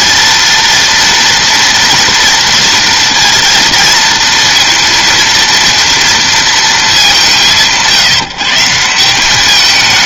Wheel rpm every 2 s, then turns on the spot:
230, 230, 230, 230, 150.
none